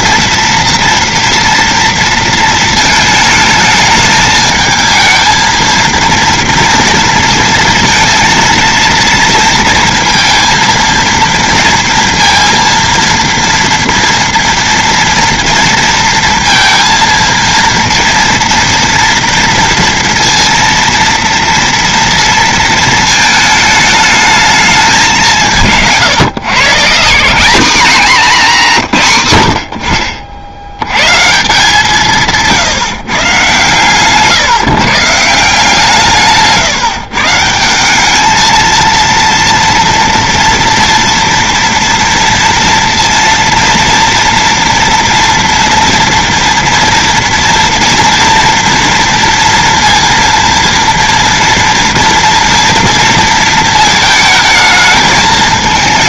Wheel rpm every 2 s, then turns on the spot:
230, 230, 220, 230, 230, 230, 230, 230, 230, 230, 230, 230, 220, 150, 210, 50, 160, 140, 160, 200, 230, 230, 240, 230, 230, 230, 240, 220.
34-36